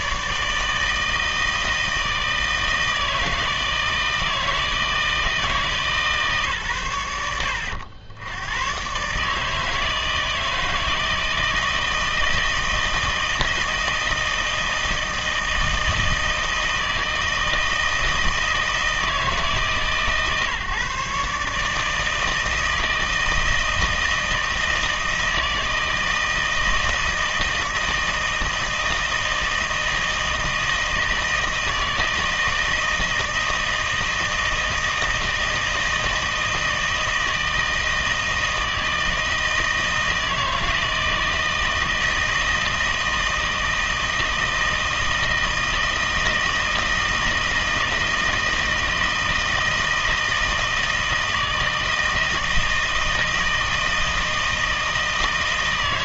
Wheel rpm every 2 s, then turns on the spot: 160, 160, 160, 130, 110, 160, 160, 160, 160, 160, 140, 160, 160, 160, 160, 160, 160, 160, 160, 160, 160, 160, 160, 160, 160, 160, 160, 160.
none